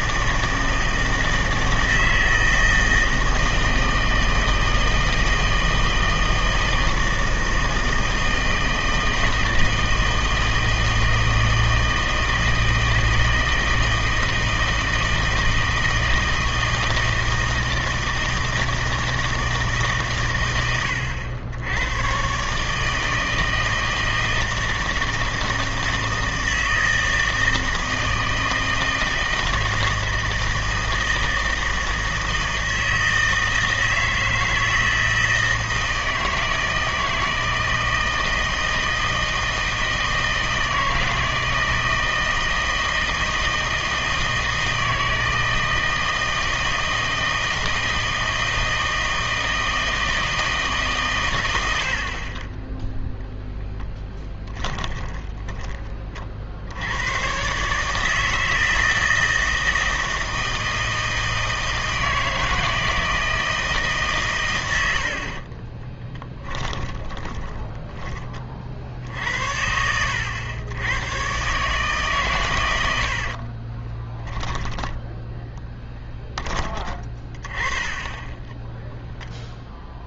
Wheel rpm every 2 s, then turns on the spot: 160, 160, 160, 160, 160, 160, 160, 160, 160, 160, 90, 150, 160, 160, 160, 160, 160, 160, 160, 160, 160, 160, 160, 160, 160, 140, 10, 20, 80, 160, 160, 160, 90, 20, 60, 100, 100, 10, 20, 10.
54-56 66-68 72-76 78-80